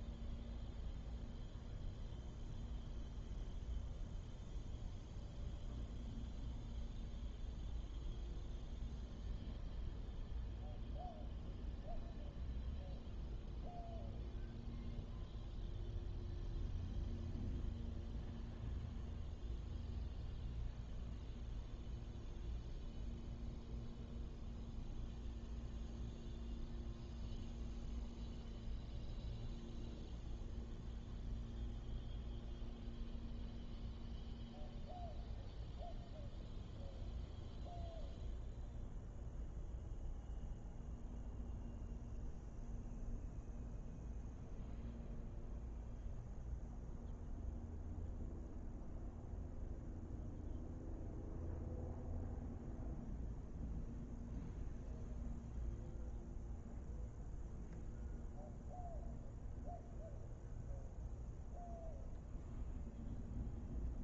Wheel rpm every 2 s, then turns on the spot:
0, 0, 0, 0, 0, 0, 0, 0, 0, 0, 0, 0, 0, 0, 0, 0, 0, 0, 0, 0, 0, 0, 0, 0, 0, 0, 0, 0, 0, 0, 0, 0.
none